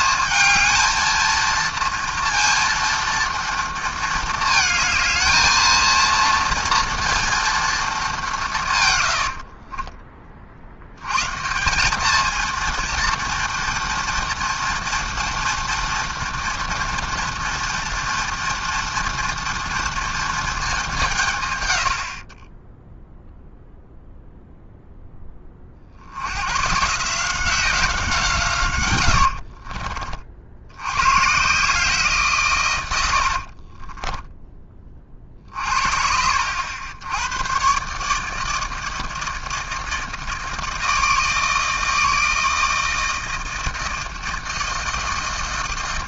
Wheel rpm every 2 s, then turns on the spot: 220, 230, 220, 230, 70, 150, 230, 240, 230, 230, 150, 0, 20, 170, 70, 140, 70, 40, 100, 160, 160, 160, 160.
8-10 28-30 32-34